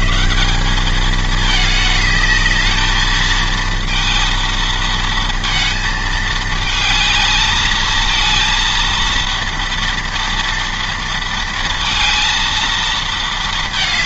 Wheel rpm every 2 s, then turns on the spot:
120, 210, 230, 220, 220, 230, 230.
none